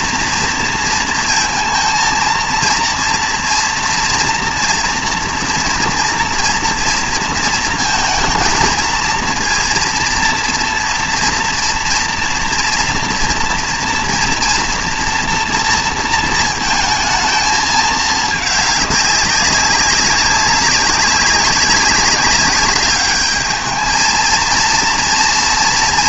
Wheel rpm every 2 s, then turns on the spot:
230, 230, 230, 230, 230, 230, 230, 230, 230, 210, 190, 200, 230.
none